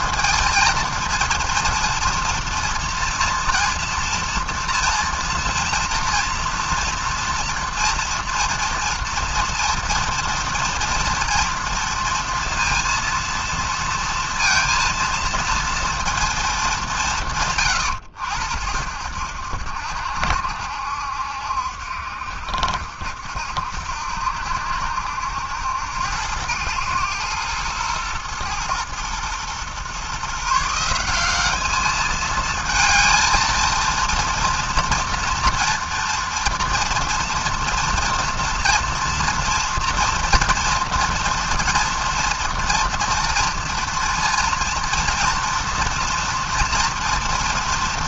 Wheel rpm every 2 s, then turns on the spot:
230, 230, 230, 240, 230, 230, 230, 230, 200, 80, 70, 70, 70, 110, 120, 170, 220, 230, 230, 240, 230, 240, 240, 230.
none